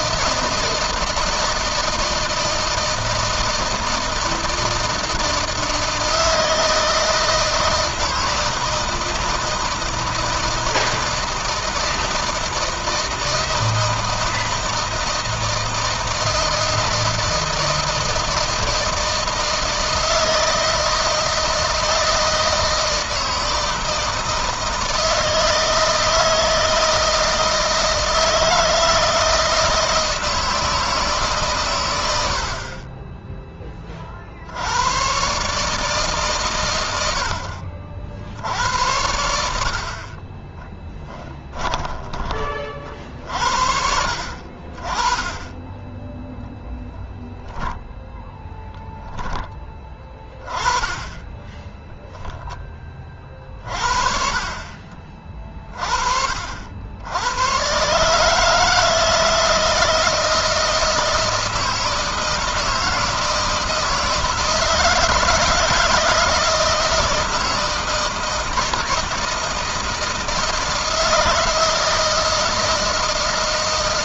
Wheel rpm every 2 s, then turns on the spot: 160, 160, 160, 160, 160, 160, 160, 160, 160, 160, 160, 160, 160, 160, 160, 160, 30, 100, 110, 80, 10, 40, 30, 10, 10, 20, 30, 40, 80, 160, 160, 160, 160, 160, 160, 160, 160.
40-42 50-52